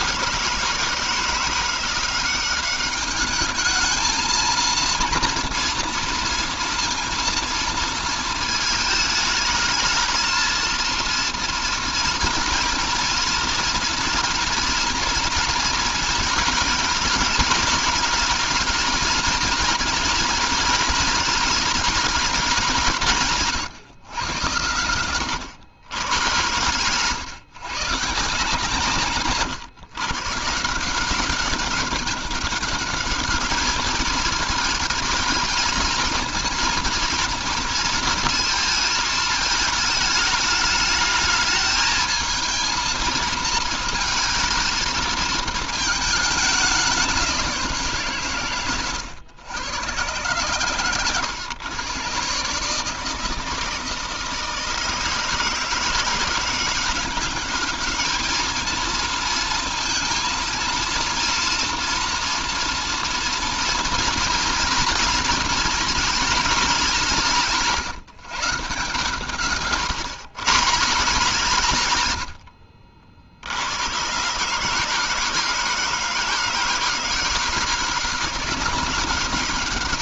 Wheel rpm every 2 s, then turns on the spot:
160, 200, 230, 230, 220, 230, 240, 230, 210, 220, 220, 170, 100, 120, 140, 170, 200, 220, 230, 220, 210, 220, 220, 200, 120, 120, 150, 170, 190, 230, 230, 230, 230, 190, 140, 150, 60, 150, 160, 190.
none